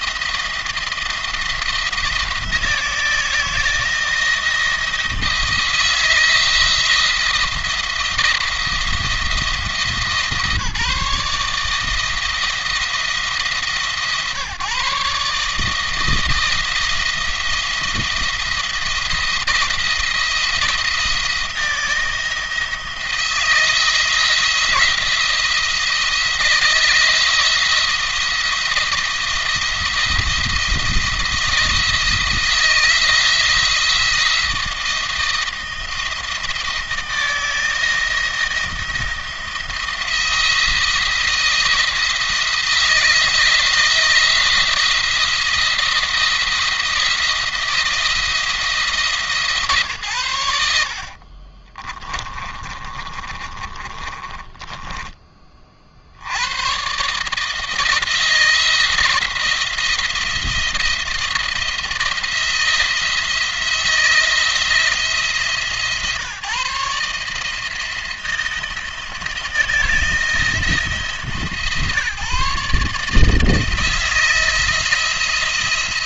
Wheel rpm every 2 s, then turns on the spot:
170, 160, 160, 170, 170, 160, 170, 140, 170, 170, 170, 170, 170, 170, 170, 170, 170, 170, 170, 170, 160, 160, 170, 170, 160, 80, 40, 20, 110, 170, 170, 170, 170, 150, 160, 160, 150, 170.
50-56